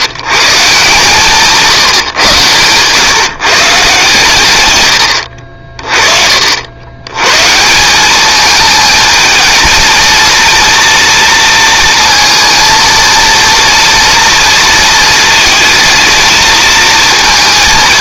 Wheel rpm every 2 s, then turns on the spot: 140, 120, 110, 80, 220, 230, 230, 230, 220.
none